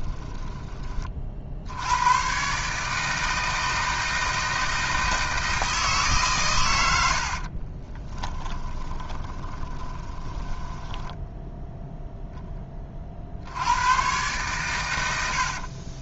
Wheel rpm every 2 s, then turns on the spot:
40, 150, 160, 80, 20, 10, 40, 90.
6-12